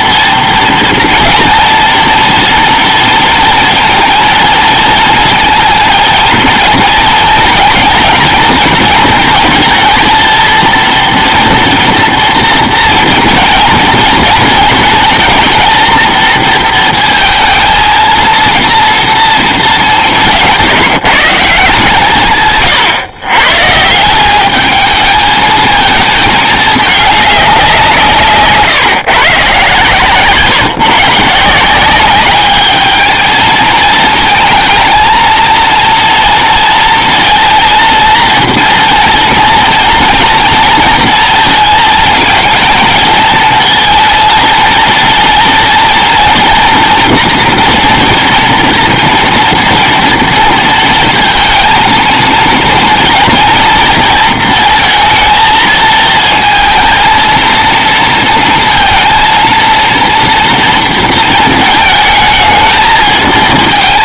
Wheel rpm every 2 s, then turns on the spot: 230, 230, 230, 230, 230, 230, 230, 220, 230, 230, 160, 140, 210, 210, 150, 130, 210, 220, 230, 230, 230, 220, 230, 230, 230, 230, 230, 220, 230, 230, 230, 220.
none